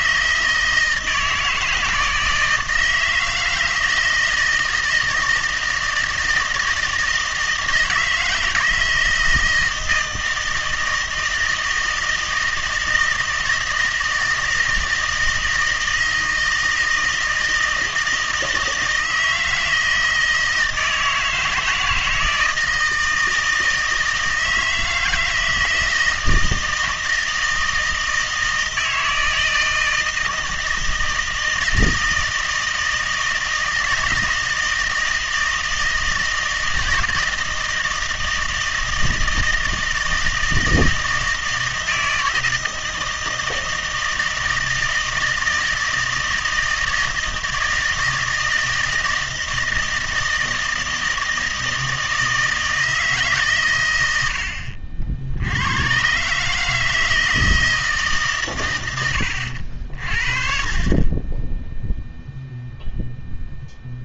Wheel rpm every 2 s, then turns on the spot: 160, 160, 160, 170, 160, 160, 160, 160, 160, 160, 160, 160, 160, 170, 160, 160, 160, 160, 160, 160, 160, 160, 160, 160, 160, 160, 160, 70, 150, 130, 30, 0.
none